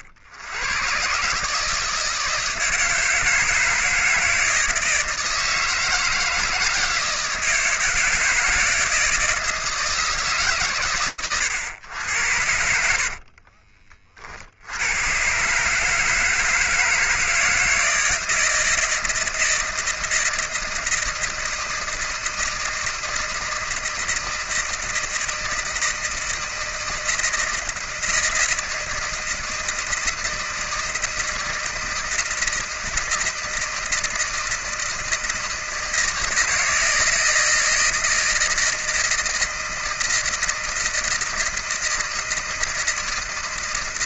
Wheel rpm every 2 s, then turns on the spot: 80, 160, 160, 160, 160, 140, 90, 60, 160, 160, 160, 160, 160, 160, 160, 160, 160, 160, 170, 160, 160, 160.
none